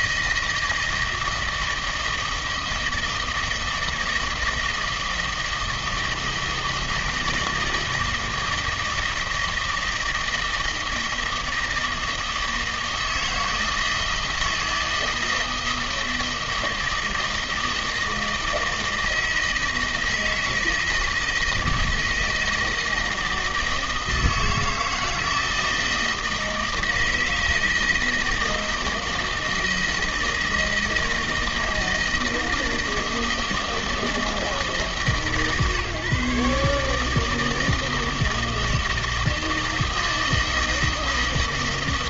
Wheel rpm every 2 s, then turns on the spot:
160, 160, 160, 160, 160, 160, 160, 160, 160, 160, 160, 160, 160, 160, 160, 160, 160, 150, 150, 160, 160.
none